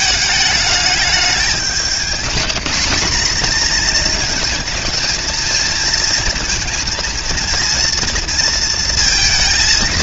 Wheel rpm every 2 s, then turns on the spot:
200, 200, 220, 230, 230.
none